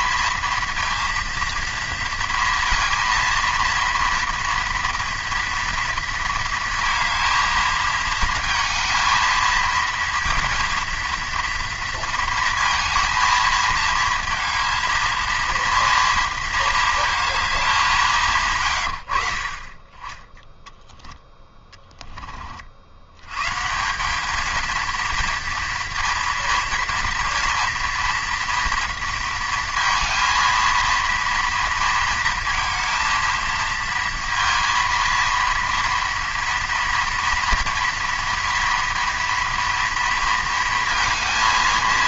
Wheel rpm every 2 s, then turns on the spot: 230, 230, 230, 220, 220, 230, 220, 230, 230, 140, 10, 60, 220, 230, 230, 230, 230, 230, 230, 230, 230.
18-20